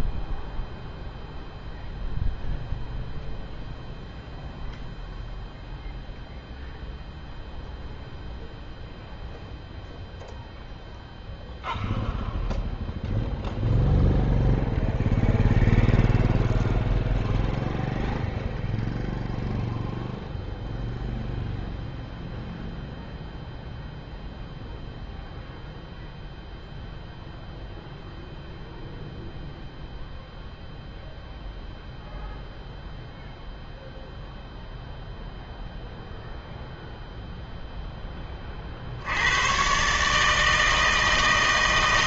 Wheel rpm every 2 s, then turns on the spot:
0, 0, 0, 0, 0, 0, 0, 0, 0, 0, 0, 0, 0, 0, 0, 0, 0, 0, 0, 60, 160.
none